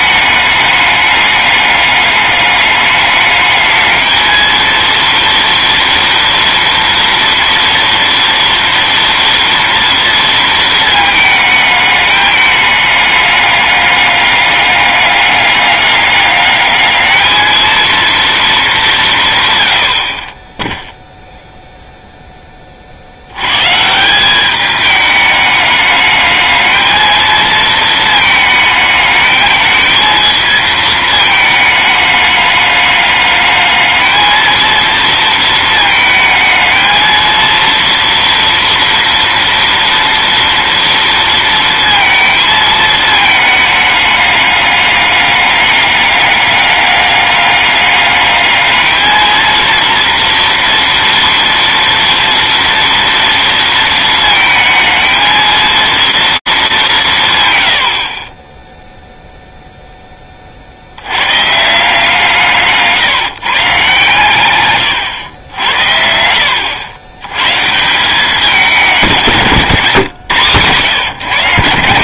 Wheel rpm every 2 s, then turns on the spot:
210, 210, 230, 240, 230, 220, 210, 200, 200, 200, 10, 30, 200, 220, 220, 220, 210, 230, 220, 230, 230, 220, 210, 200, 220, 230, 240, 220, 190, 0, 60, 140, 110, 90, 180, 120.
none